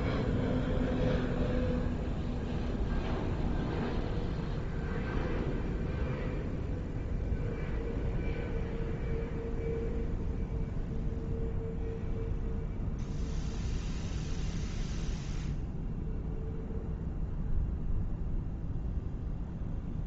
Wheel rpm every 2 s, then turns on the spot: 0, 0, 0, 0, 0, 0, 0, 0, 0, 0.
none